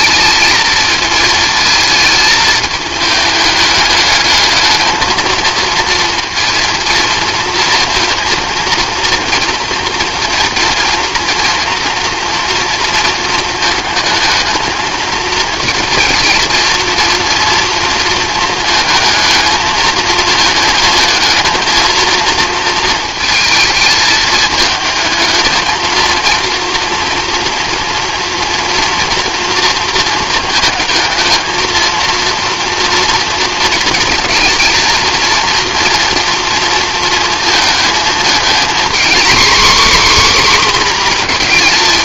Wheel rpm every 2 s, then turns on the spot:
220, 220, 220, 230, 230, 230, 230, 220, 240, 220, 220, 230, 220, 230, 230, 220, 230, 230, 230, 240, 260.
none